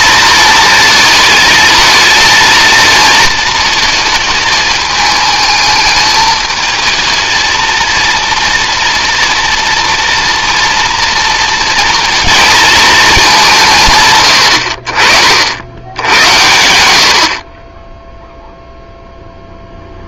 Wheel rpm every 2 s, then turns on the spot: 230, 230, 210, 220, 230, 230, 230, 60, 100, 0.
none